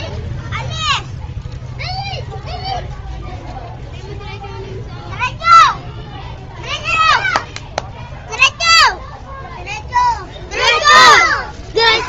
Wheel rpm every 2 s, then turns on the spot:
0, 0, 0, 0, 0, 130.
none